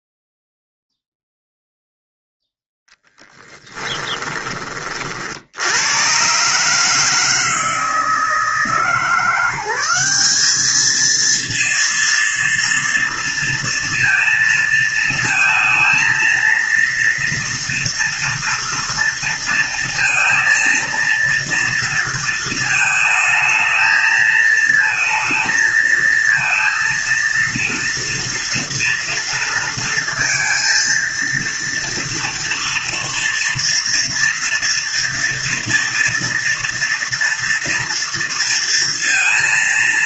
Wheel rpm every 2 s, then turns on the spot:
0, 0, 30, 150, 160, 210, 230, 230, 230, 230, 230, 220, 220, 230, 230, 230, 230, 230, 230, 230.
none